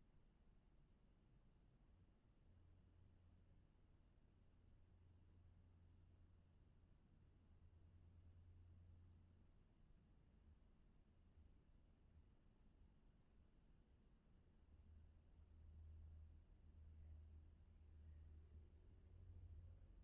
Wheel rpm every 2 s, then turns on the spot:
0, 0, 0, 0, 0, 0, 0, 0, 0, 0.
none